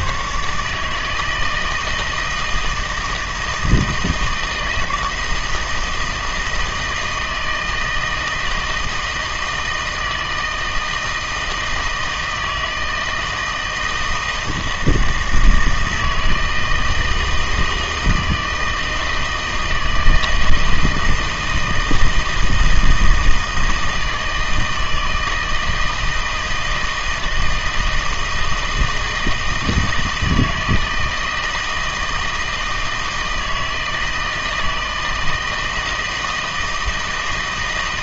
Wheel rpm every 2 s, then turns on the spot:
150, 160, 160, 160, 160, 160, 160, 160, 160, 160, 160, 160, 160, 160, 160, 160, 160, 160, 160.
none